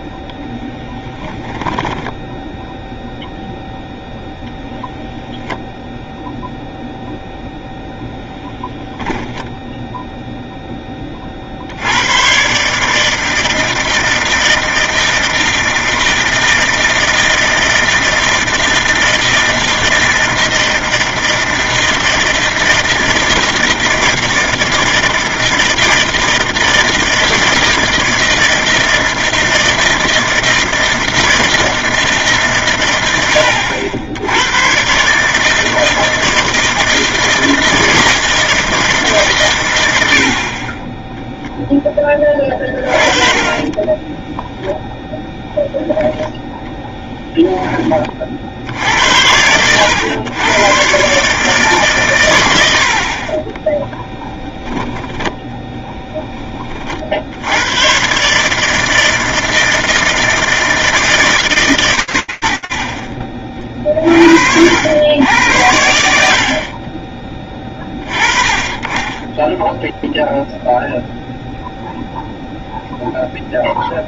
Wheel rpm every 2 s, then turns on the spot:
10, 0, 0, 0, 10, 10, 150, 160, 160, 160, 160, 160, 160, 160, 160, 160, 120, 130, 160, 160, 10, 30, 0, 10, 70, 120, 60, 0, 40, 160, 160, 40, 90, 20, 20, 0, 0.
46-48